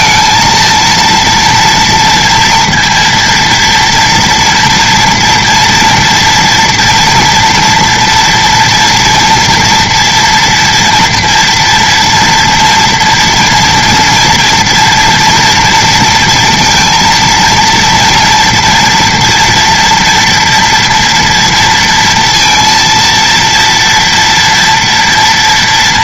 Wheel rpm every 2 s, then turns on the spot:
230, 230, 240, 230, 230, 240, 230, 230, 230, 230, 230, 230, 230.
none